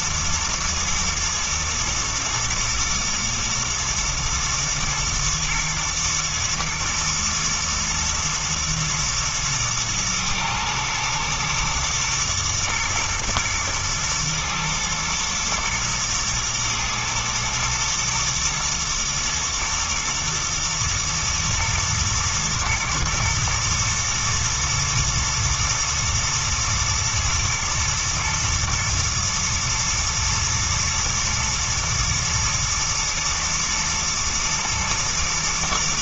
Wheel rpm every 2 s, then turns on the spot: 120, 110, 110, 110, 110, 110, 120, 120, 110, 110, 110, 110, 110, 120, 120, 110, 110, 110.
none